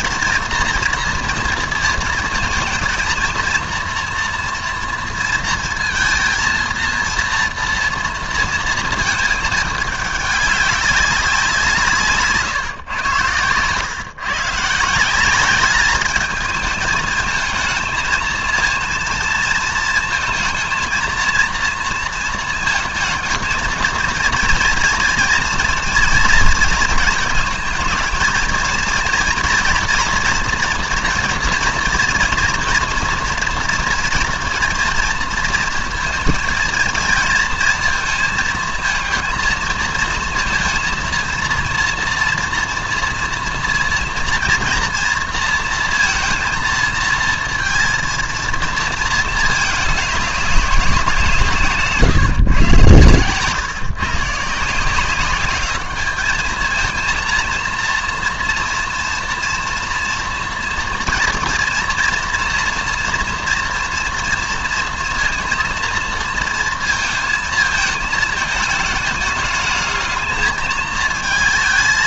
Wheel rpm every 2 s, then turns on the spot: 230, 230, 230, 230, 230, 200, 140, 160, 220, 230, 230, 220, 230, 230, 230, 240, 230, 240, 230, 230, 230, 230, 230, 230, 230, 190, 130, 170, 220, 230, 230, 230, 230, 230, 220, 220.
none